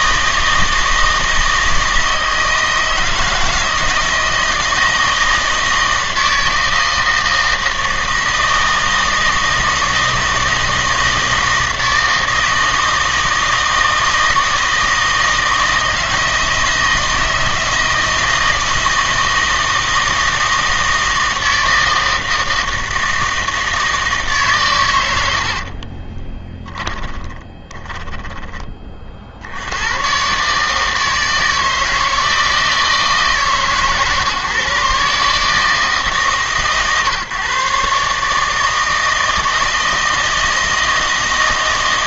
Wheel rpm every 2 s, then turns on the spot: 160, 160, 160, 160, 160, 170, 160, 160, 160, 160, 160, 160, 130, 10, 20, 140, 160, 130, 140, 160, 160.
26-28